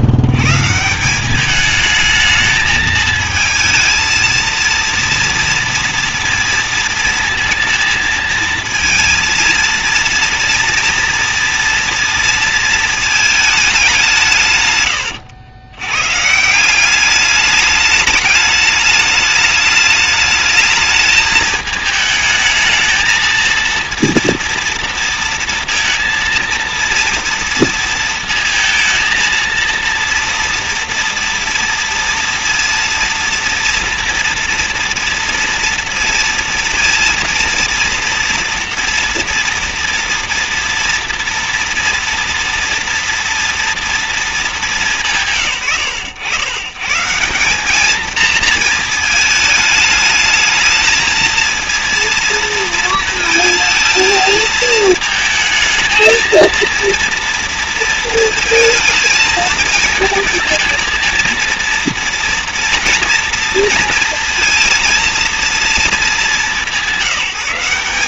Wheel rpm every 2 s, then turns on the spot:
140, 220, 230, 230, 230, 240, 230, 120, 180, 210, 210, 220, 230, 230, 230, 230, 230, 230, 230, 240, 230, 240, 200, 120, 230, 220, 230, 220, 230, 230, 230, 230, 230, 180.
none